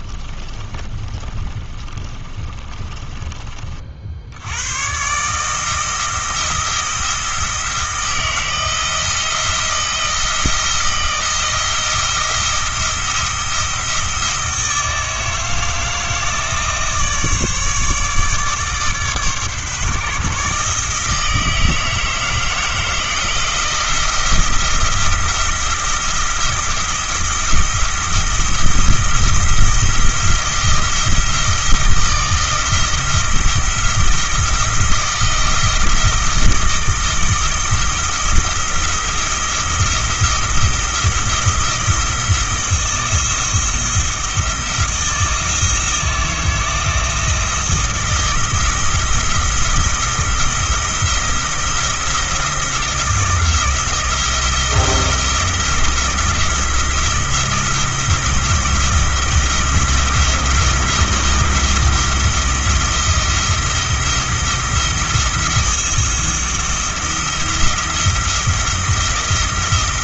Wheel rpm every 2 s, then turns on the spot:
30, 20, 110, 170, 170, 170, 170, 160, 160, 140, 150, 160, 170, 170, 170, 170, 170, 170, 160, 170, 170, 170, 170, 160, 170, 170, 170, 170, 170, 170, 170, 170, 170, 170, 170.
0-4